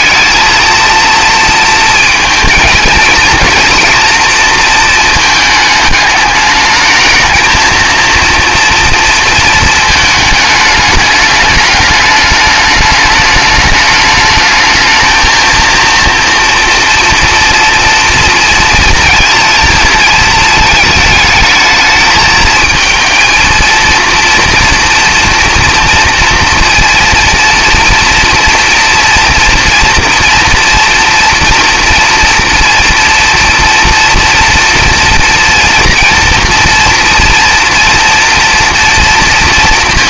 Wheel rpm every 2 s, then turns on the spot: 230, 230, 230, 210, 230, 210, 210, 220, 230, 230, 220, 220, 230, 230, 230, 240, 230, 230, 230, 240.
none